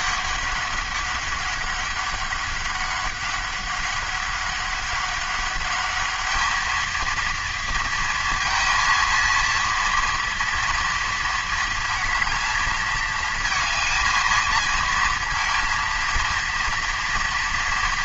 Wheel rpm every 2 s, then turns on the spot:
200, 200, 200, 220, 230, 230, 220, 230, 230.
none